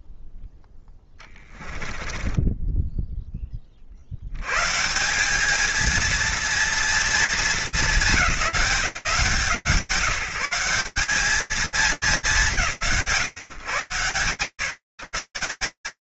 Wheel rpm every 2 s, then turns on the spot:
0, 10, 100, 230, 190, 130, 200, 130.
2-4